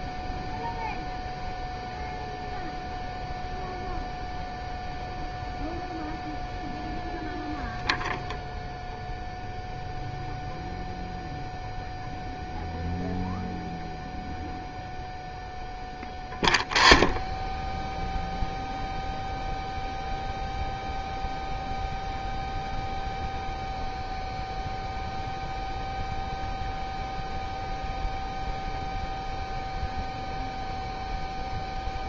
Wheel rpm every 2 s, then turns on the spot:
0, 0, 0, 0, 0, 0, 0, 0, 0, 0, 0, 0, 0, 0, 0, 0.
none